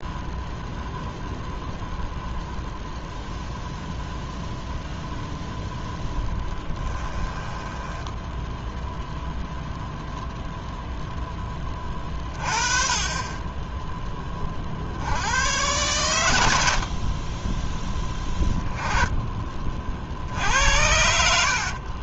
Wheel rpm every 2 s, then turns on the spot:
0, 0, 0, 10, 0, 0, 30, 60, 60, 20, 70.
6-8 16-20